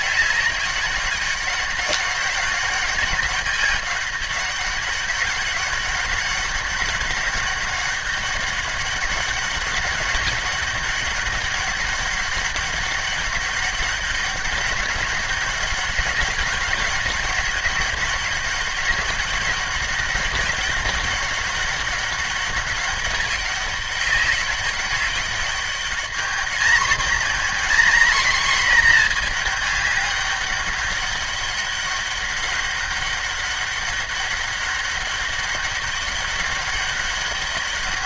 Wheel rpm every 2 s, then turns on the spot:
200, 200, 200, 200, 190, 190, 200, 200, 200, 200, 200, 200, 200, 220, 230, 200, 200, 200, 200.
none